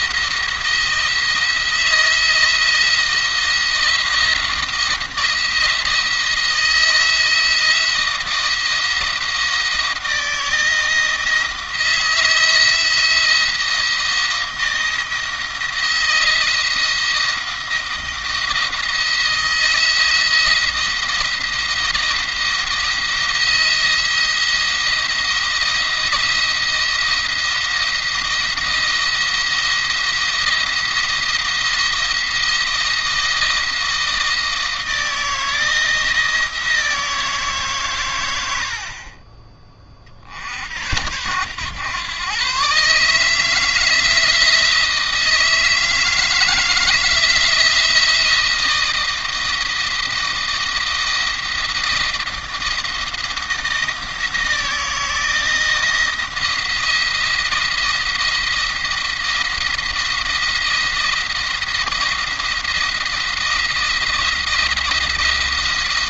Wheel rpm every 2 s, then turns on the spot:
170, 170, 170, 170, 170, 170, 170, 160, 170, 170, 170, 170, 170, 170, 170, 170, 160, 160, 170, 60, 70, 140, 160, 160, 160, 170, 170, 170, 170, 170, 170, 170, 170.
none